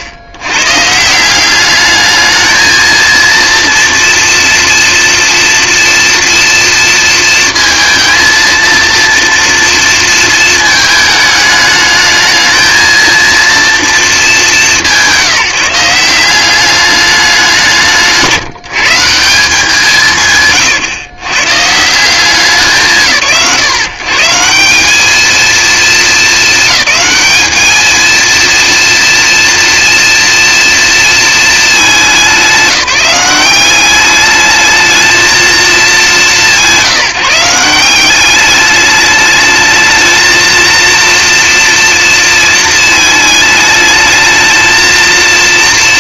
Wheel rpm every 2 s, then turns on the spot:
120, 220, 230, 230, 230, 220, 220, 200, 190, 180, 130, 170, 190, 200, 230, 230, 190, 210, 180, 200, 230, 230, 220.
20-22